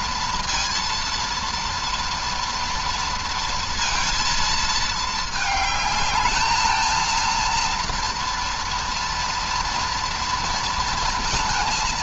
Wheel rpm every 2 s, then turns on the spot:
230, 230, 230, 220, 230, 230.
none